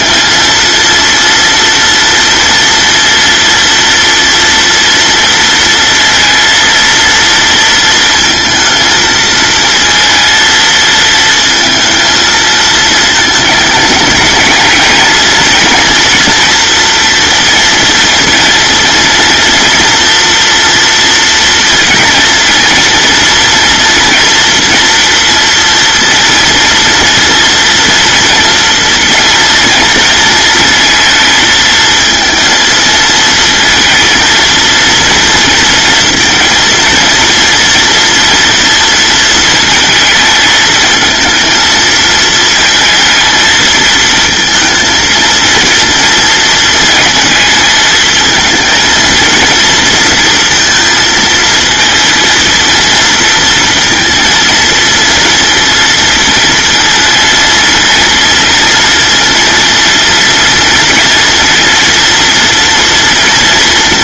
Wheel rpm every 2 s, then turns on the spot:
230, 230, 230, 230, 220, 220, 220, 230, 230, 230, 230, 230, 240, 230, 240, 220, 230, 230, 230, 230, 220, 220, 230, 220, 230, 230, 230, 230, 230, 230, 240, 230.
none